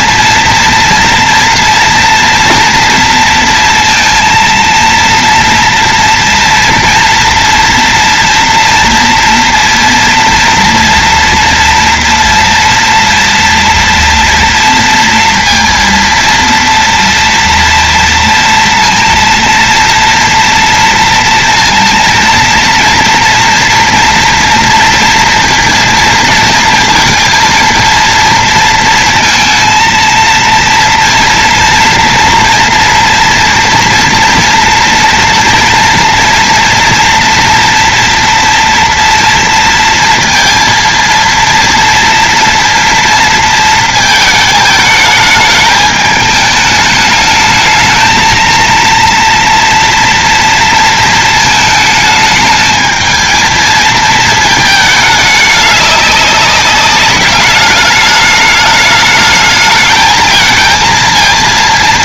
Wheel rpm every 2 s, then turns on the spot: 230, 240, 230, 230, 230, 230, 230, 230, 230, 230, 230, 230, 230, 230, 230, 230, 240, 230, 230, 230, 230, 230, 220, 210, 230, 230, 220, 220, 200, 210, 220.
none